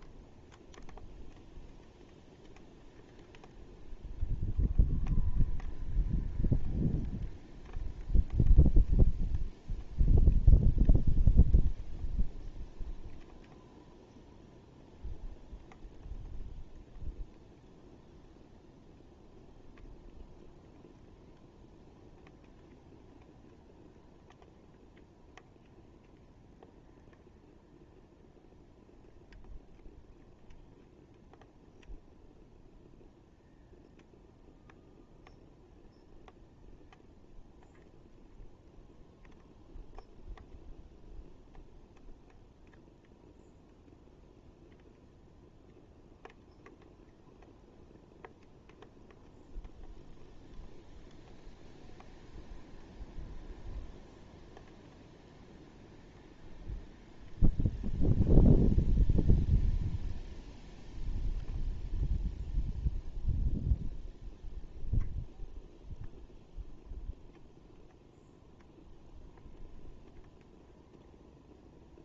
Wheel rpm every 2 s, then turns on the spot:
0, 0, 0, 0, 0, 0, 0, 0, 0, 0, 0, 0, 0, 0, 0, 0, 0, 0, 0, 0, 0, 0, 0, 0, 0, 0, 0, 0, 0, 0, 0, 0, 0, 0, 0, 0.
none